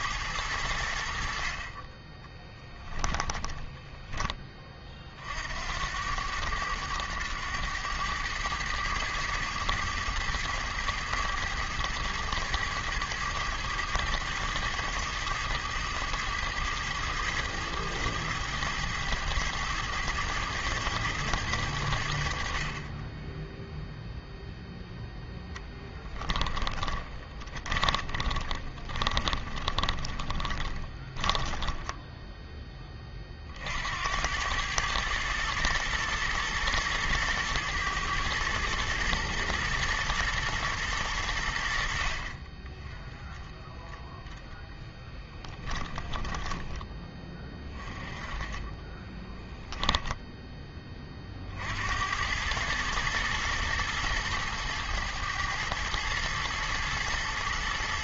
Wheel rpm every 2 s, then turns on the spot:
80, 20, 30, 100, 110, 110, 110, 110, 110, 110, 110, 40, 0, 10, 30, 20, 20, 110, 110, 110, 110, 20, 10, 20, 20, 20, 110, 110, 110.
2-4 26-32 44-46 48-50